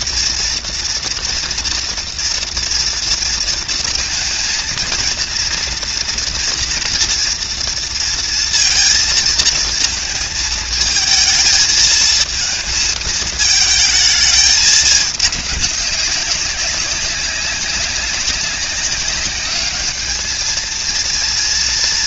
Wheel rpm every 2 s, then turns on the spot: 230, 230, 230, 230, 230, 220, 220, 220, 200, 200, 210.
none